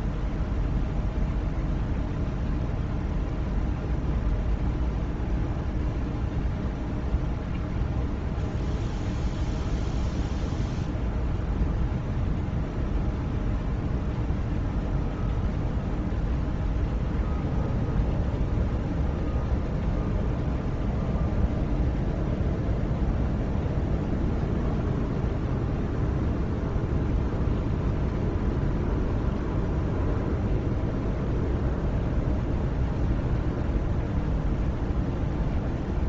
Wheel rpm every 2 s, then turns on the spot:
0, 0, 0, 0, 0, 0, 0, 0, 0, 0, 0, 0, 0, 0, 0, 0, 0, 0.
none